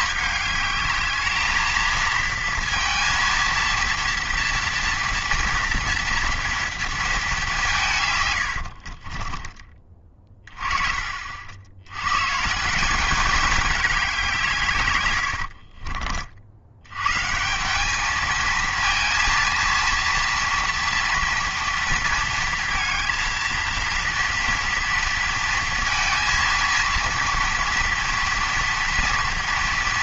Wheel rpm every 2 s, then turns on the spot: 210, 230, 230, 230, 80, 20, 170, 150, 70, 230, 230, 230, 230, 230, 230.
8-10